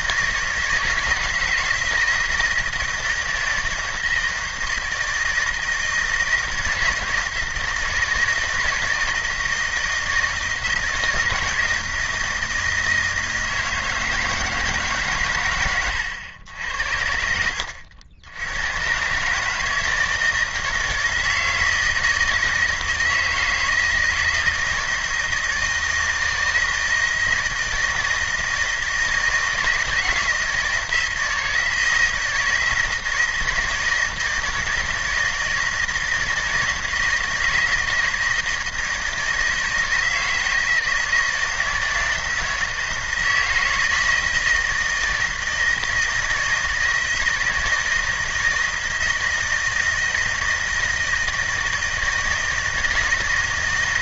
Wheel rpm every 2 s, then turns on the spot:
160, 170, 160, 160, 160, 160, 160, 160, 80, 100, 160, 160, 160, 160, 160, 160, 160, 170, 160, 160, 160, 160, 160, 160, 160, 160, 160.
none